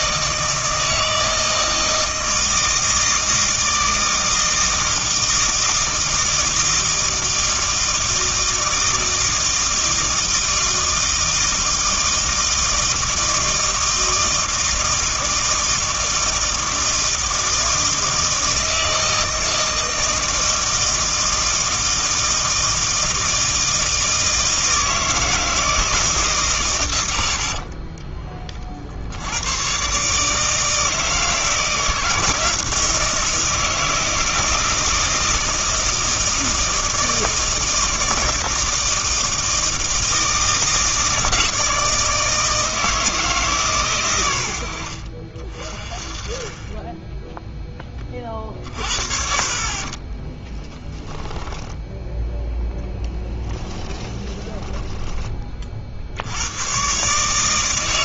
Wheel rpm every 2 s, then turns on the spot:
160, 160, 160, 160, 160, 160, 160, 160, 160, 160, 160, 160, 160, 120, 30, 160, 160, 160, 160, 160, 160, 160, 80, 20, 40, 10, 0, 10, 110.
50-52